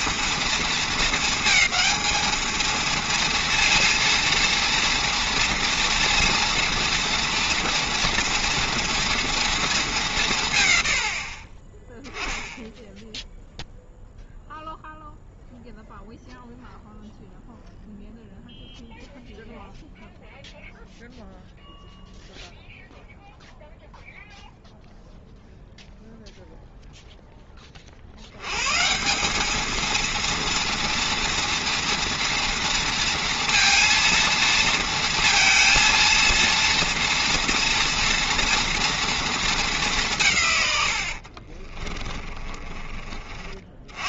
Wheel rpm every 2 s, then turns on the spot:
230, 220, 230, 230, 230, 150, 10, 0, 0, 0, 0, 0, 0, 0, 110, 230, 230, 230, 230, 230, 130, 40.
42-44